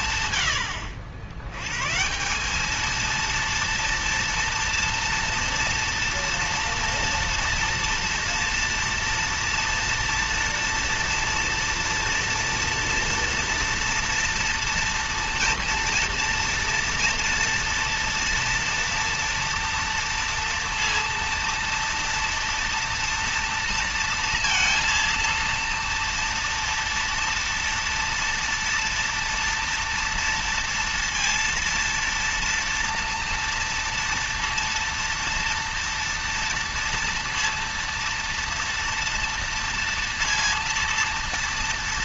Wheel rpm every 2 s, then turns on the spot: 90, 200, 240, 240, 230, 240, 230, 230, 230, 230, 230, 230, 230, 230, 230, 230, 230, 230, 230, 230, 230.
0-2